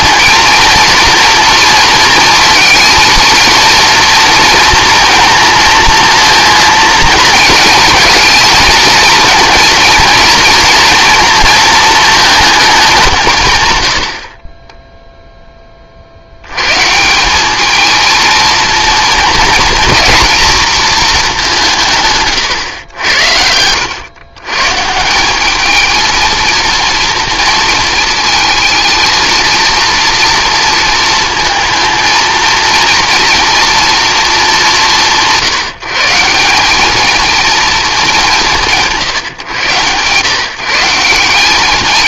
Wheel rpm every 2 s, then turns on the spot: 230, 230, 230, 230, 230, 230, 210, 20, 110, 230, 230, 120, 140, 230, 220, 230, 230, 210, 190, 170, 150.
none